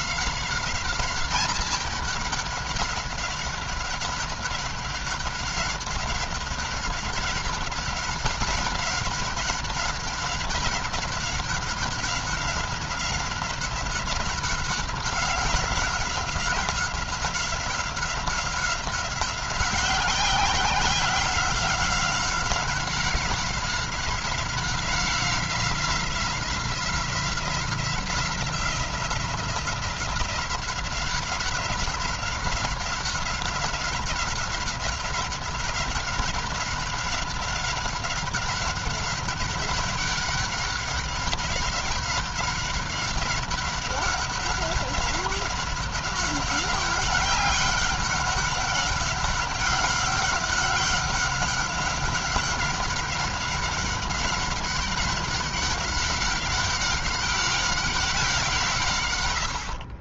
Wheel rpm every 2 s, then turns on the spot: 190, 200, 190, 200, 200, 190, 190, 190, 190, 190, 180, 190, 190, 180, 180, 180, 190, 190, 190, 200, 200, 190, 190, 190, 190, 190, 200, 190, 190, 140.
none